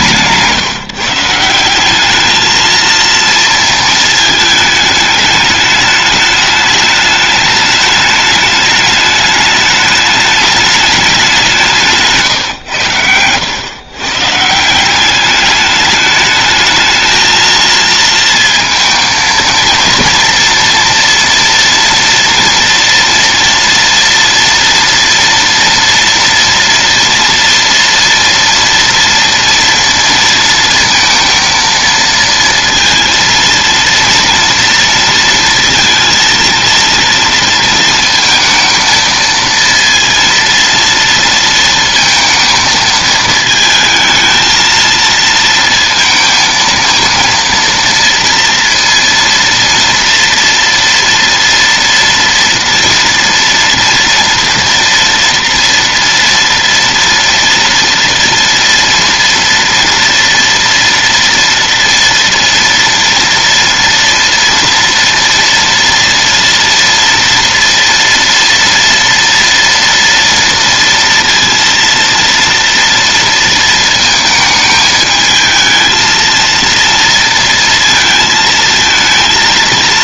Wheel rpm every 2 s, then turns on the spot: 160, 220, 210, 210, 210, 210, 110, 160, 220, 230, 240, 230, 230, 230, 230, 230, 230, 230, 230, 220, 230, 220, 230, 230, 230, 230, 230, 230, 230, 230, 230, 230, 230, 230, 230, 230, 230, 220, 230, 220.
none